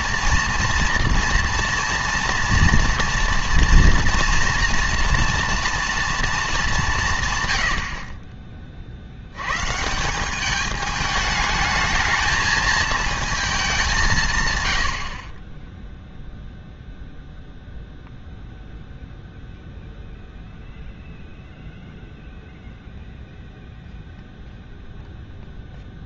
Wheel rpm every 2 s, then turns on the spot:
230, 240, 230, 210, 30, 210, 220, 110, 0, 0, 0, 0, 0.
14-16